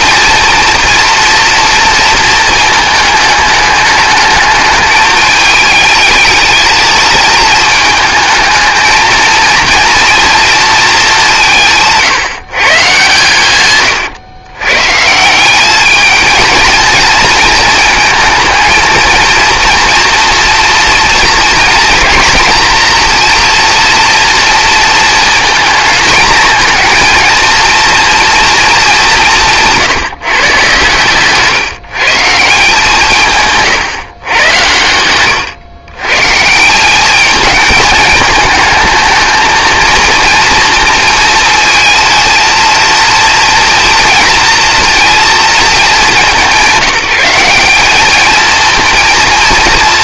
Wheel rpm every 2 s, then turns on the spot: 230, 220, 210, 220, 220, 220, 140, 140, 230, 230, 230, 230, 230, 230, 210, 130, 170, 110, 190, 220, 230, 230, 230, 190, 230.
30-32